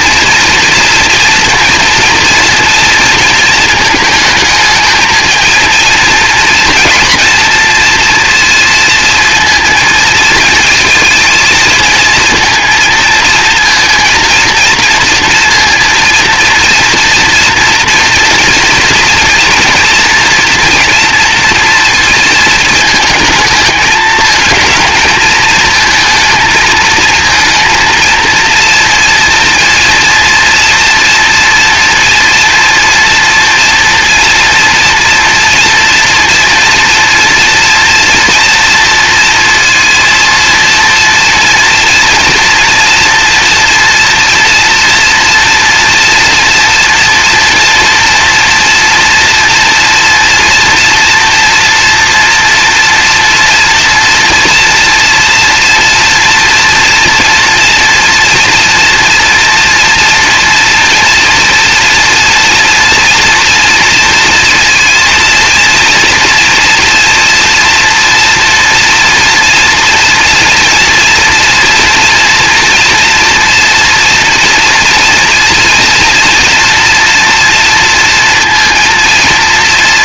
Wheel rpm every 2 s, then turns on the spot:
230, 230, 220, 220, 230, 220, 230, 230, 230, 240, 230, 230, 220, 220, 230, 230, 230, 230, 230, 230, 230, 230, 230, 240, 230, 230, 240, 230, 230, 230, 230, 230, 230, 240, 230, 230, 230, 240, 230, 230.
none